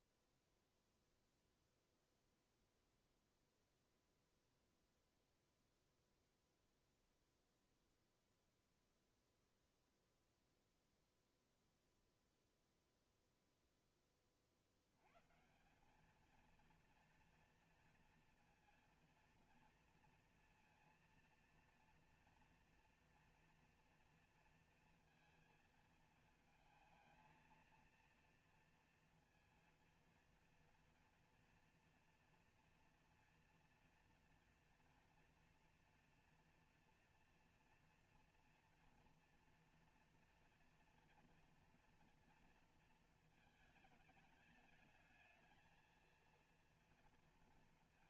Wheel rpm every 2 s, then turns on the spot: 0, 0, 0, 0, 0, 0, 0, 60, 230, 230, 230, 240, 230, 220, 230, 230, 240, 230, 230, 240, 240, 230, 210, 230.
none